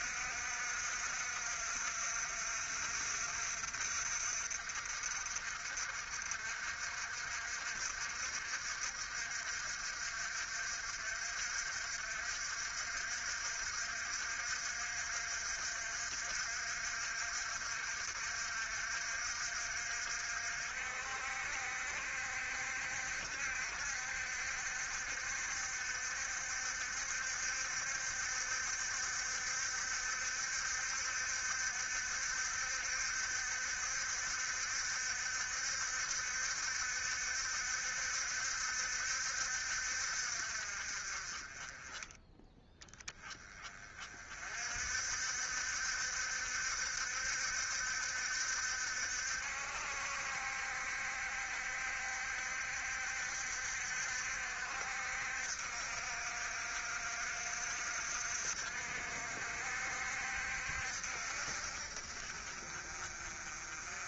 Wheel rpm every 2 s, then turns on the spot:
60, 60, 60, 60, 60, 60, 60, 60, 60, 60, 60, 60, 60, 70, 70, 70, 70, 70, 70, 70, 40, 10, 60, 70, 70, 70, 70, 60, 60, 60, 70, 40.
none